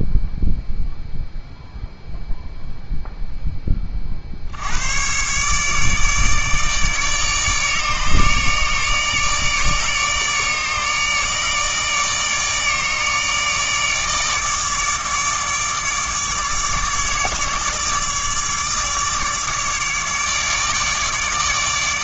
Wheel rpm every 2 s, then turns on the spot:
0, 0, 90, 150, 150, 150, 150, 150, 150, 150, 150.
none